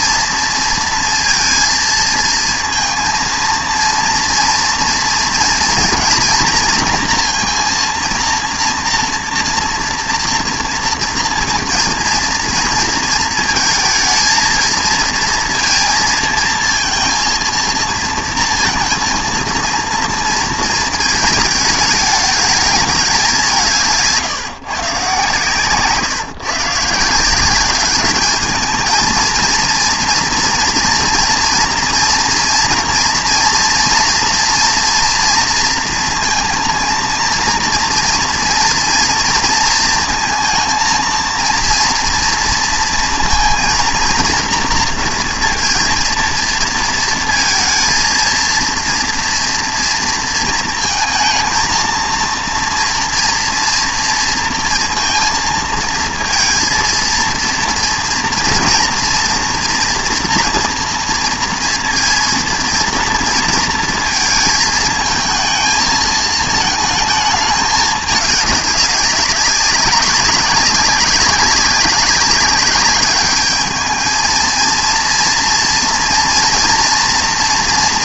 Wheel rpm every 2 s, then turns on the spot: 230, 230, 230, 230, 230, 230, 230, 220, 230, 230, 220, 210, 140, 140, 220, 230, 230, 230, 220, 230, 230, 230, 230, 230, 230, 220, 230, 230, 230, 230, 230, 230, 220, 220, 200, 200, 200, 220, 240.
none